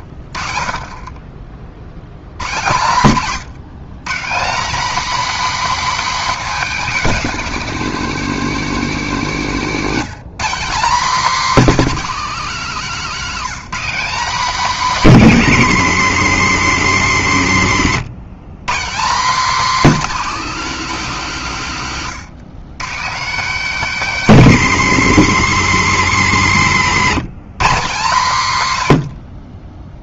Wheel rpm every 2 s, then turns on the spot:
30, 130, 240, 260, 220, 230, 220, 230, 170, 170, 210, 160, 200, 150, 120.
26-28